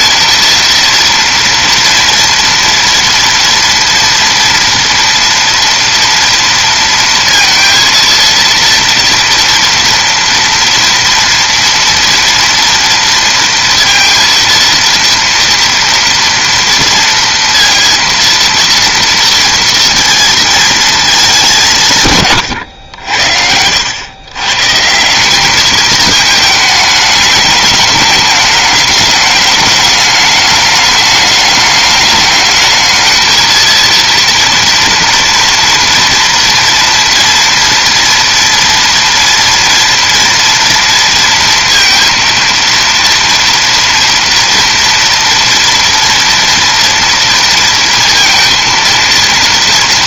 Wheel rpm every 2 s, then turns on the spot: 230, 230, 230, 230, 230, 230, 230, 230, 230, 230, 220, 100, 150, 210, 210, 210, 210, 230, 230, 230, 230, 230, 230, 230, 230.
none